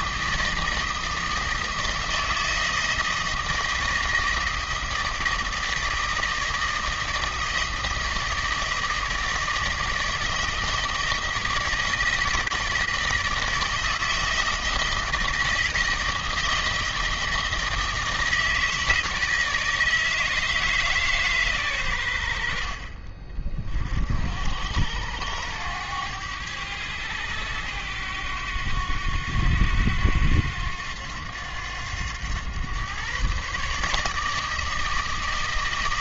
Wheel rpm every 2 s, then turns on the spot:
160, 160, 160, 160, 160, 160, 160, 160, 160, 160, 150, 40, 80, 100, 90, 90, 120, 160.
none